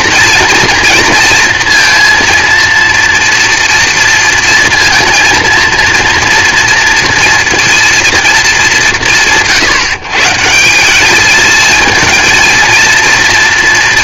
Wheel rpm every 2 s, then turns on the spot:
230, 230, 230, 230, 200, 170, 230.
none